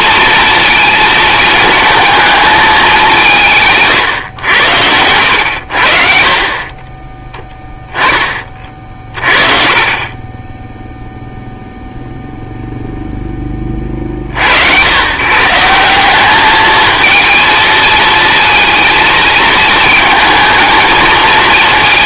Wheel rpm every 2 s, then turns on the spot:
230, 210, 100, 40, 30, 10, 0, 80, 210, 230, 220.
none